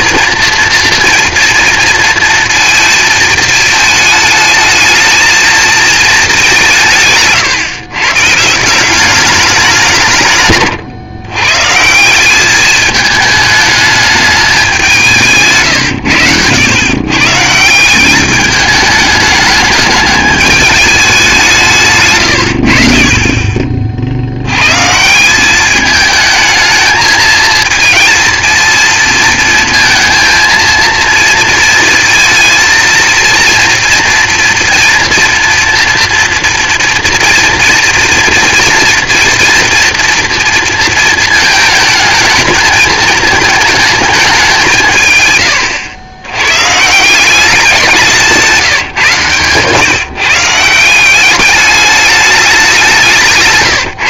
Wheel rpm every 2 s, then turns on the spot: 230, 230, 220, 180, 170, 130, 210, 200, 110, 210, 210, 60, 120, 220, 230, 230, 230, 240, 240, 240, 230, 220, 160, 120, 160, 170, 190.
48-50